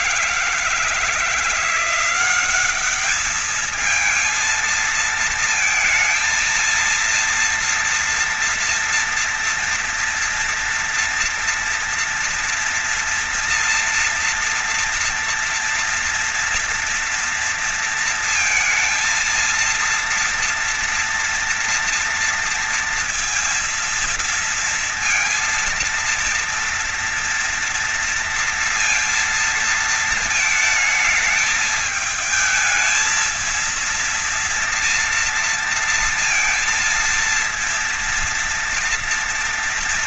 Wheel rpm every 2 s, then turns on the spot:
170, 190, 230, 230, 230, 230, 230, 230, 230, 230, 230, 230, 230, 230, 230, 220, 220, 230, 230, 230.
none